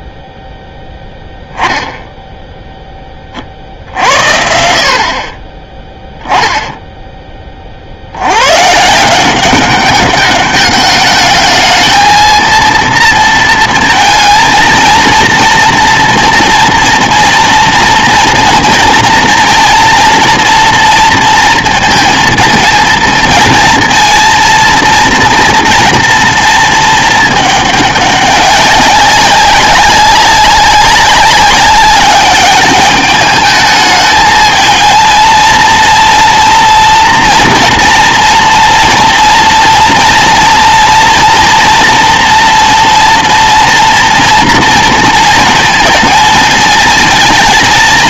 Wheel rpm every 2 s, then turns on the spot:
0, 0, 70, 10, 150, 210, 230, 230, 230, 230, 230, 230, 230, 230, 200, 200, 210, 220, 230, 230, 230, 230, 230, 220.
none